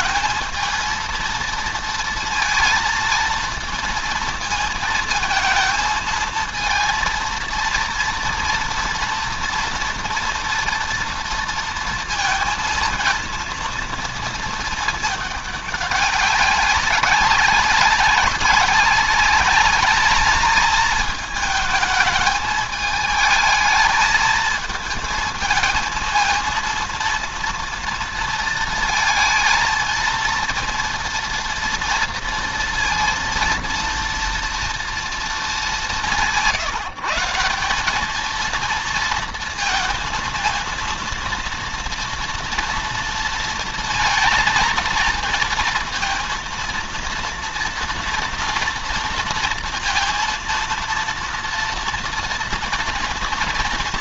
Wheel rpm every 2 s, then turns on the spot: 220, 230, 220, 230, 230, 230, 230, 220, 190, 190, 220, 220, 220, 230, 230, 230, 230, 230, 170, 230, 230, 230, 220, 230, 230, 230, 230.
none